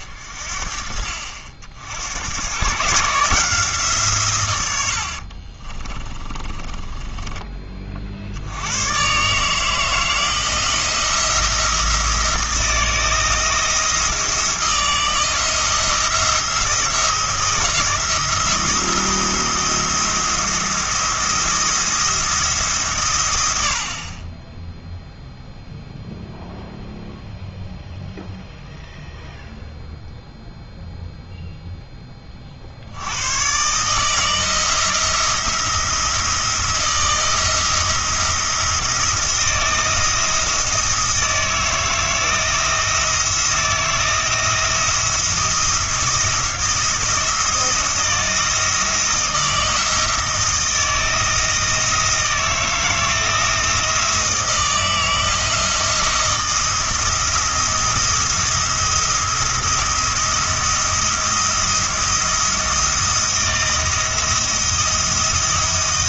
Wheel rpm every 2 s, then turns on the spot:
50, 150, 90, 20, 100, 170, 160, 170, 170, 170, 170, 140, 10, 0, 0, 0, 70, 160, 170, 170, 170, 160, 170, 170, 170, 170, 170, 170, 170, 170, 170, 170, 170.
6-8